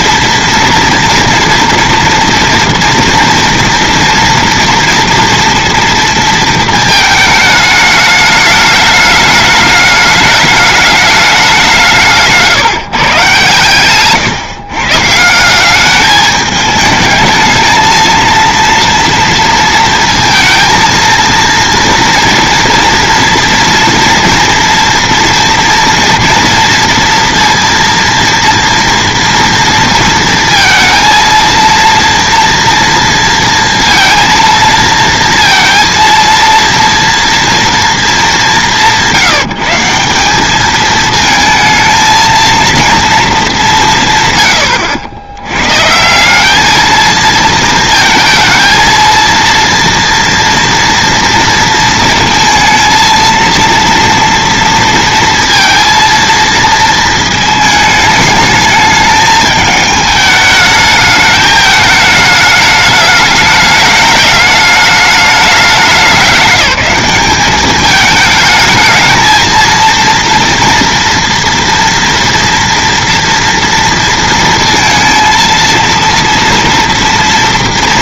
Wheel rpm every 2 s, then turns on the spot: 230, 230, 230, 220, 210, 210, 150, 130, 210, 230, 230, 230, 230, 230, 230, 230, 230, 230, 230, 200, 200, 230, 100, 200, 220, 230, 220, 230, 230, 220, 210, 210, 210, 200, 220, 230, 230, 230, 230.
none